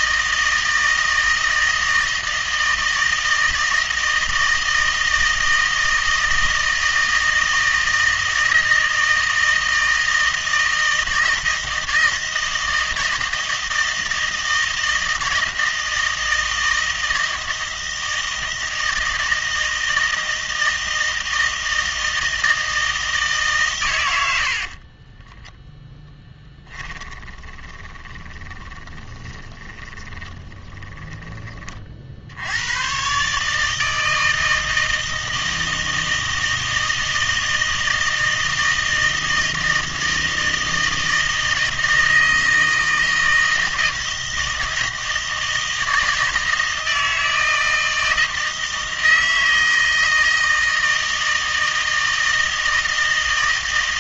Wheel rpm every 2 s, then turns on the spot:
160, 160, 160, 160, 160, 160, 160, 160, 160, 160, 160, 160, 40, 10, 20, 20, 110, 160, 160, 160, 160, 160, 160, 160, 160, 160, 160.
24-32